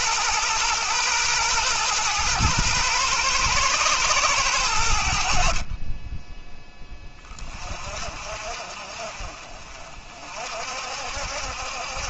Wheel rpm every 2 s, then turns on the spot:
120, 110, 80, 20, 50, 60.
none